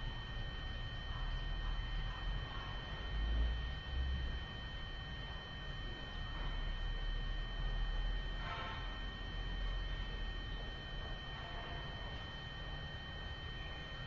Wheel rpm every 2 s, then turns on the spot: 0, 0, 0, 0, 0, 0, 0.
none